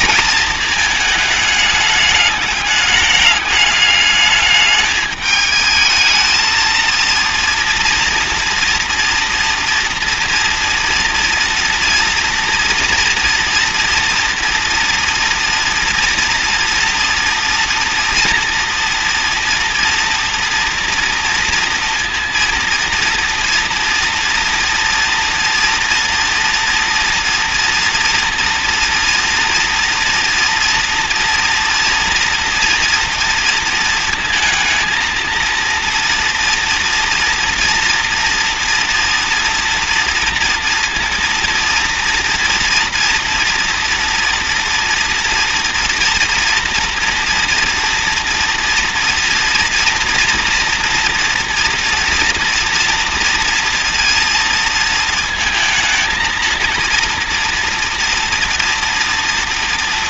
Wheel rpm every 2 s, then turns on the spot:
230, 210, 210, 220, 230, 240, 230, 240, 230, 230, 230, 230, 230, 240, 230, 230, 230, 230, 230, 230, 230, 240, 230, 230, 230, 230, 230, 230, 230, 230.
none